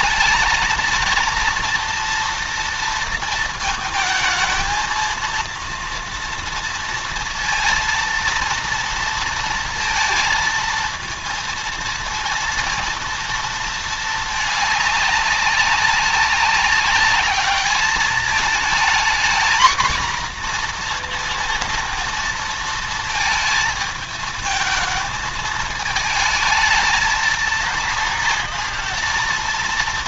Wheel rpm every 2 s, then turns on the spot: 220, 230, 220, 230, 230, 220, 230, 210, 200, 220, 240, 230, 220, 220, 230.
none